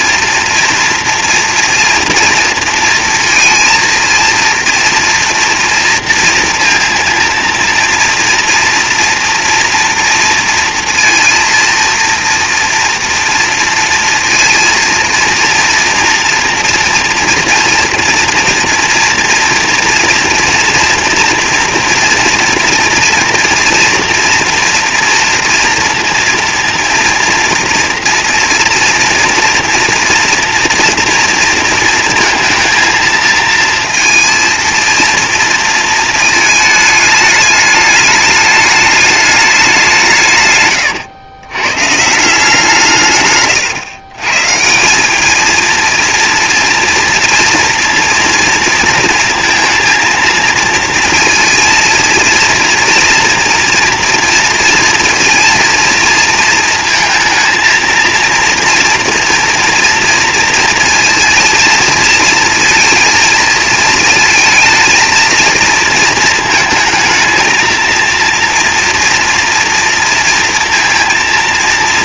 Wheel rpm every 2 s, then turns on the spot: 240, 230, 230, 230, 230, 230, 230, 230, 240, 230, 230, 230, 240, 230, 230, 240, 230, 230, 220, 210, 120, 160, 170, 230, 230, 230, 230, 230, 230, 230, 230, 230, 220, 220, 230, 230.
40-42